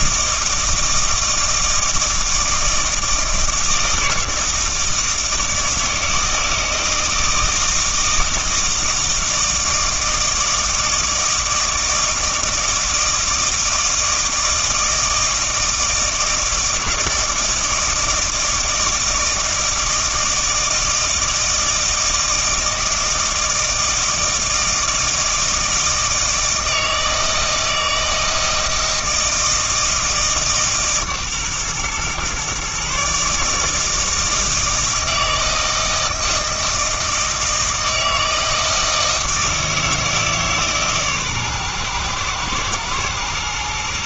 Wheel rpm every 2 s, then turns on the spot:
160, 160, 160, 160, 160, 160, 160, 160, 160, 160, 160, 160, 160, 160, 160, 150, 140, 160, 160, 160, 140, 120.
none